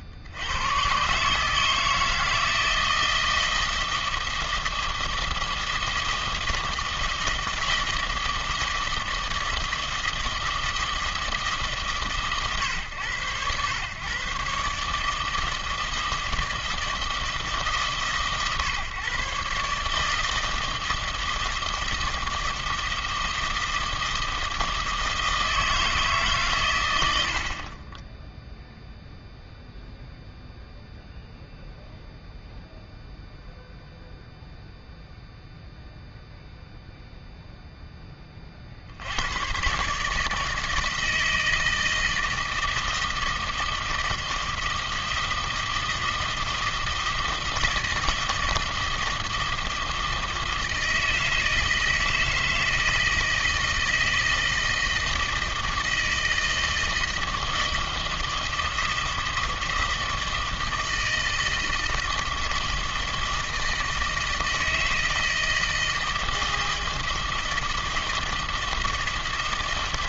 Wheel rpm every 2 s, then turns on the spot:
80, 160, 160, 160, 160, 160, 110, 130, 160, 120, 160, 160, 160, 130, 0, 0, 0, 0, 0, 40, 160, 160, 160, 160, 160, 160, 160, 160, 160, 160, 160, 160, 160, 160, 160.
none